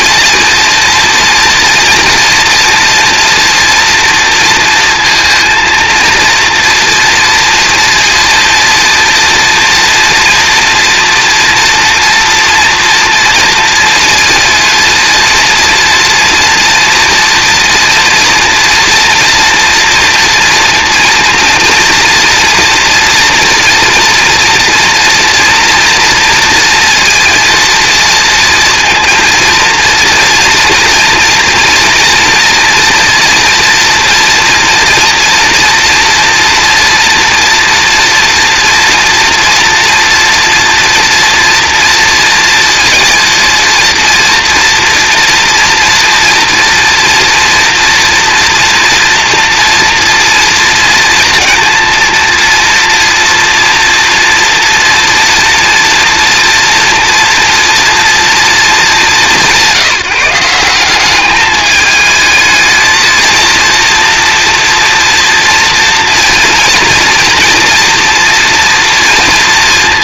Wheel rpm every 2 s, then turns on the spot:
230, 230, 230, 240, 230, 230, 230, 230, 230, 240, 230, 230, 230, 230, 230, 230, 230, 240, 230, 230, 240, 230, 230, 230, 240, 230, 230, 230, 240, 220, 190, 230, 240, 240, 230.
none